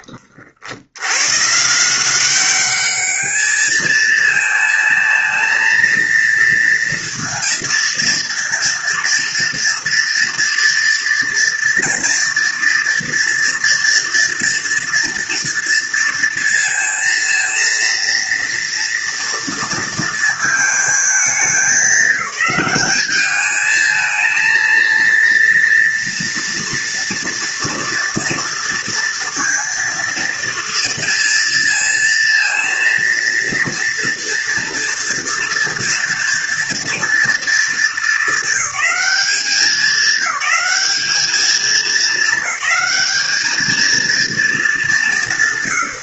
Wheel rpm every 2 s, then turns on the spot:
80, 210, 230, 230, 230, 230, 230, 230, 230, 230, 220, 210, 230, 240, 230, 230, 230, 230, 230, 210, 210, 210, 180.
none